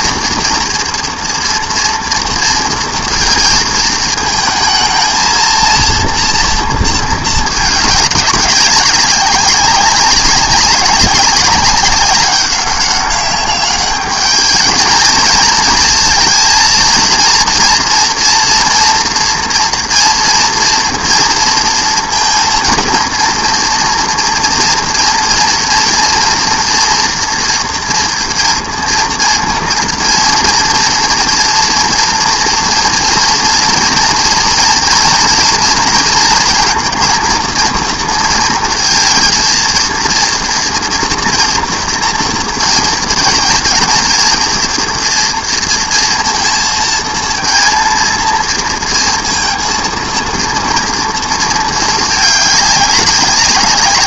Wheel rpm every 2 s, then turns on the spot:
230, 230, 220, 230, 200, 190, 200, 220, 230, 240, 230, 230, 230, 230, 230, 230, 230, 230, 230, 230, 240, 230, 240, 220, 230, 230, 200.
none